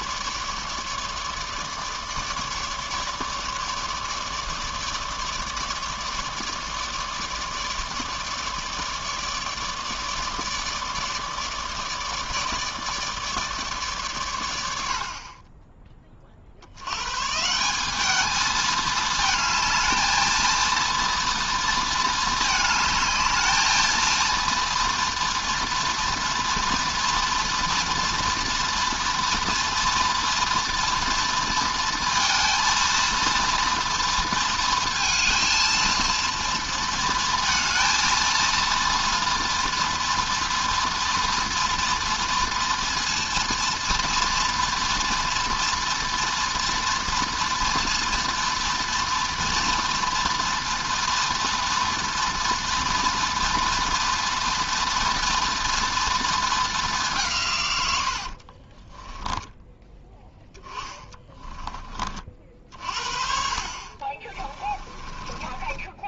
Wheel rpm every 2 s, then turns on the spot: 150, 150, 150, 150, 150, 150, 150, 100, 60, 210, 220, 210, 230, 230, 230, 230, 230, 230, 230, 230, 240, 230, 240, 230, 230, 230, 230, 230, 220, 40, 10, 50, 30.
58-62 64-66